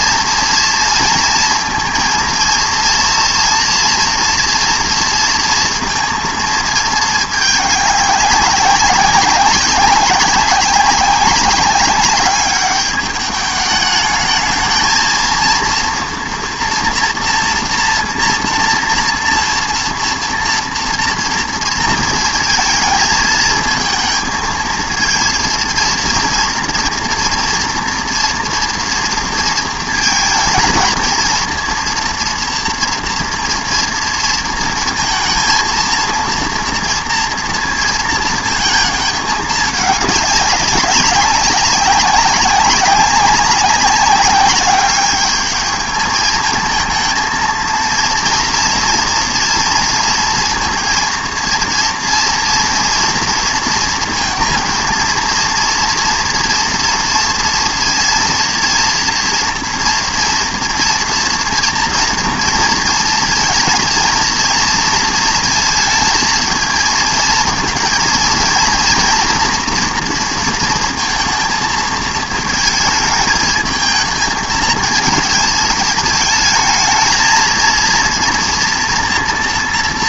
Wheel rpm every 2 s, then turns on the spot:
230, 230, 240, 230, 190, 190, 210, 220, 230, 230, 230, 220, 230, 230, 230, 230, 230, 230, 230, 220, 190, 190, 200, 220, 240, 230, 230, 230, 230, 230, 230, 230, 230, 220, 230, 230, 220, 220, 220, 240.
none